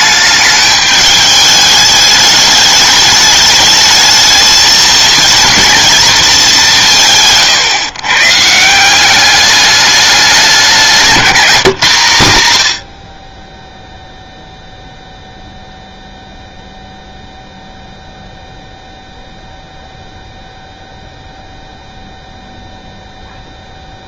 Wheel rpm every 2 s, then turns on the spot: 210, 210, 220, 180, 170, 190, 90, 0, 0, 0, 0, 0.
none